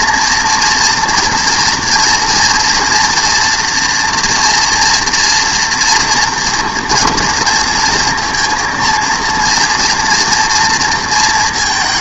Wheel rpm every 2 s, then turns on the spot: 240, 230, 230, 230, 230, 230.
none